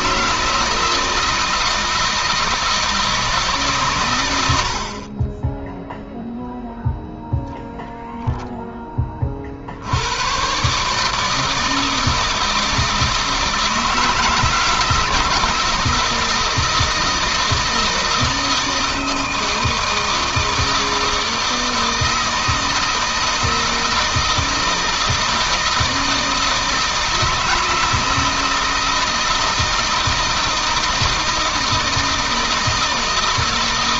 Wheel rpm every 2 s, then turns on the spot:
160, 160, 80, 0, 0, 130, 160, 170, 160, 160, 160, 160, 160, 160, 160, 160, 160.
none